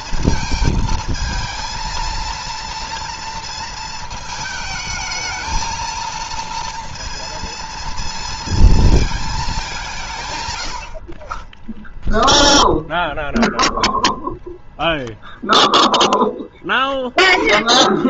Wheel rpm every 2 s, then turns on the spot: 220, 230, 220, 230, 220, 70, 0, 0, 10.
none